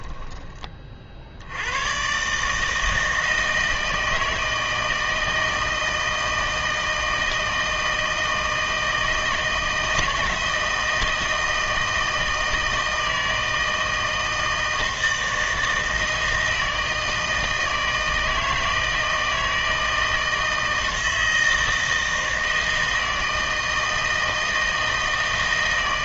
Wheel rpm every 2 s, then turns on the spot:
30, 150, 160, 160, 160, 160, 160, 160, 160, 160, 160, 160, 160.
none